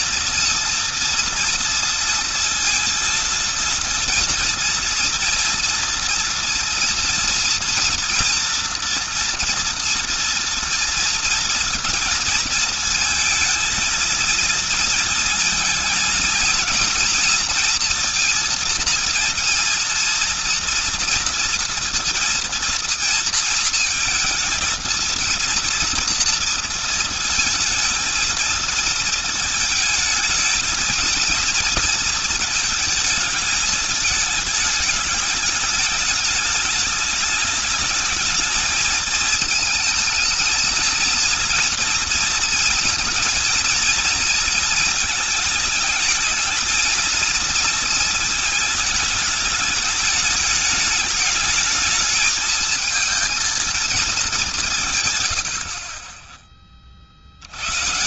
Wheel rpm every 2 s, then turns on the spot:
230, 230, 230, 230, 230, 230, 220, 220, 230, 230, 230, 230, 230, 230, 220, 220, 220, 210, 210, 220, 230, 230, 230, 220, 220, 210, 220, 170, 30.
none